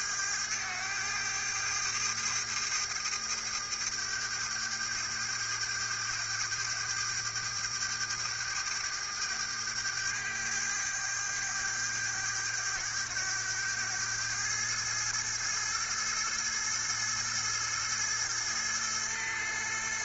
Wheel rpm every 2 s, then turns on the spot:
100, 100, 100, 100, 100, 100, 100, 110, 110, 110.
none